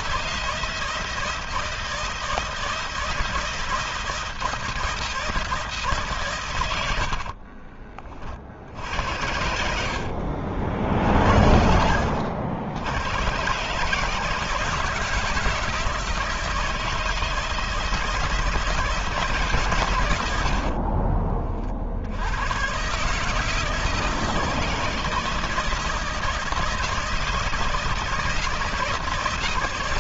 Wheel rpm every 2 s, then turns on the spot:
160, 160, 160, 90, 60, 50, 100, 160, 160, 160, 50, 130, 160, 160, 160.
6-12 20-22